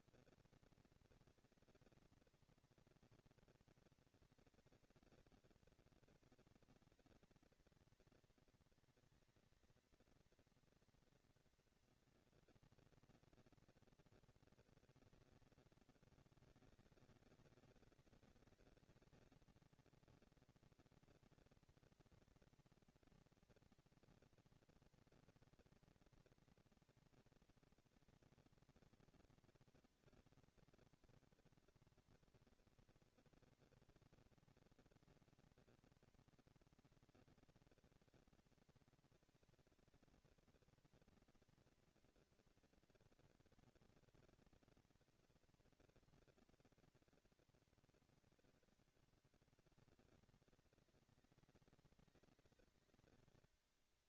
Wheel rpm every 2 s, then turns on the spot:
230, 230, 230, 230, 230, 230, 240, 230, 200, 200, 230, 230, 230, 230, 230, 230, 230, 230, 230, 230, 230, 230, 230, 230, 200, 190, 200.
none